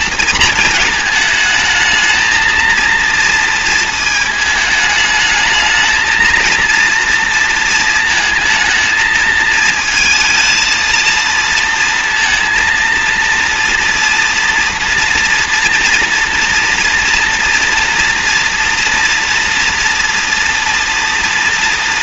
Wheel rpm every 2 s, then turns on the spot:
220, 230, 220, 230, 220, 230, 230, 240, 240, 240, 240.
none